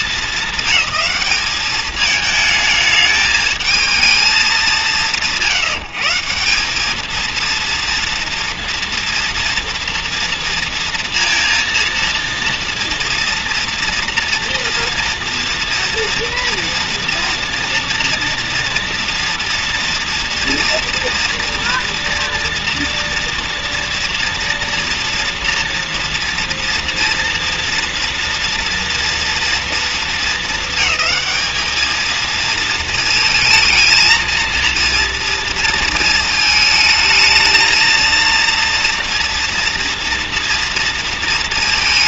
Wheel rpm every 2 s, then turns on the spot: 200, 220, 200, 180, 230, 240, 230, 230, 240, 230, 230, 230, 240, 230, 230, 210, 220, 230, 220, 230, 230.
none